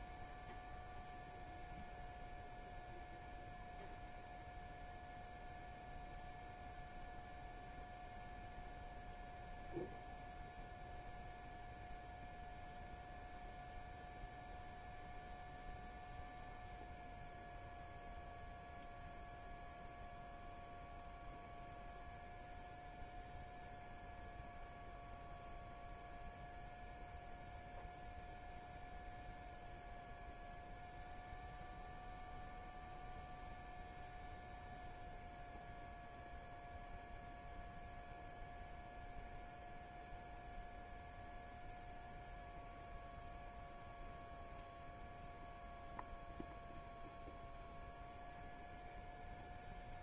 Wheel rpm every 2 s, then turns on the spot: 0, 0, 0, 0, 0, 0, 0, 0, 0, 0, 0, 0, 0, 0, 0, 0, 0, 0, 0, 0, 0, 0, 0, 0, 0.
none